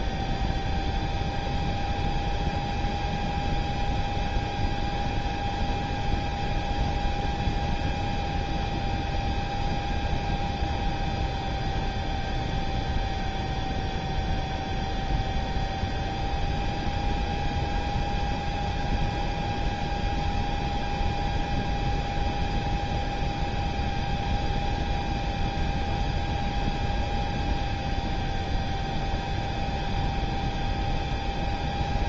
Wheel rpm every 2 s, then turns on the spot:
0, 0, 0, 0, 0, 0, 0, 0, 0, 0, 0, 0, 0, 0, 0, 0.
none